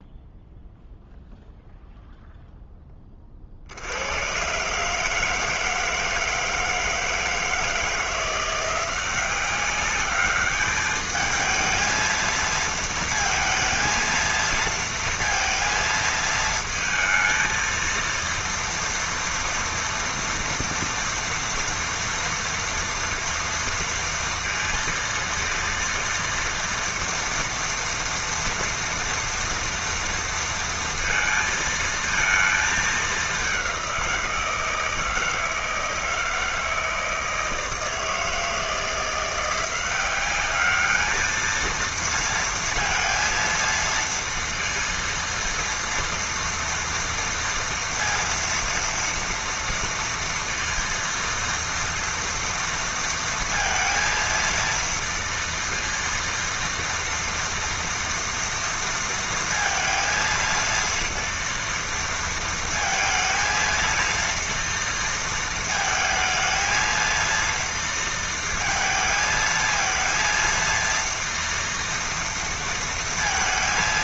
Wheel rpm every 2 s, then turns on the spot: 0, 0, 130, 160, 170, 210, 220, 230, 220, 230, 230, 230, 230, 230, 230, 230, 220, 170, 160, 160, 200, 230, 230, 230, 230, 230, 230, 230, 230, 230, 230, 230, 230, 220, 230, 230, 230.
none